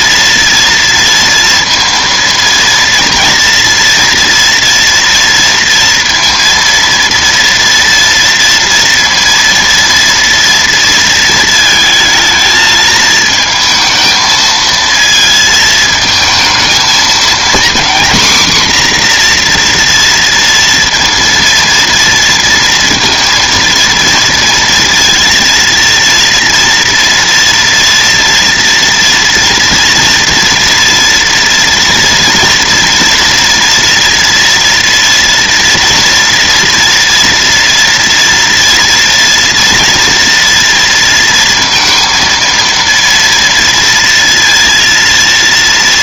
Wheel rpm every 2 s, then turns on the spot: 230, 230, 230, 230, 230, 230, 220, 230, 230, 260, 230, 230, 230, 230, 230, 240, 230, 230, 230, 230, 230, 230, 230.
none